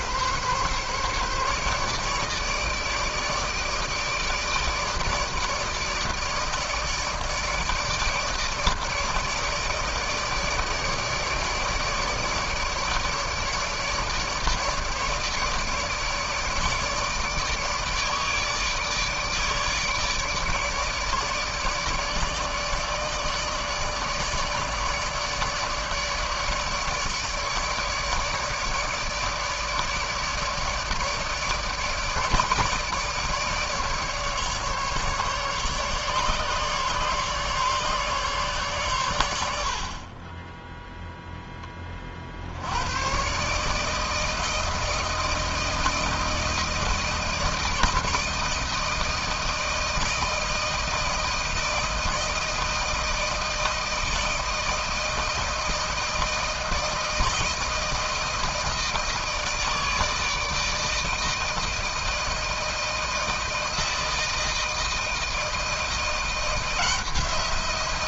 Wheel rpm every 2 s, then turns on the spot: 140, 150, 160, 150, 150, 150, 150, 150, 150, 150, 150, 150, 150, 150, 150, 150, 150, 150, 140, 140, 20, 70, 160, 160, 160, 160, 160, 160, 160, 160, 160, 160, 160, 170.
none